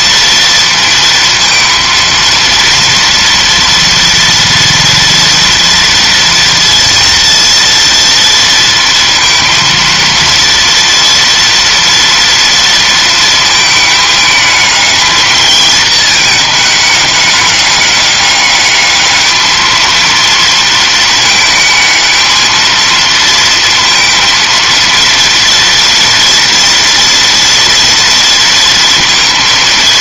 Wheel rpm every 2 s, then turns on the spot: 230, 230, 230, 230, 230, 230, 220, 220, 210, 210, 220, 230, 230, 230, 230.
none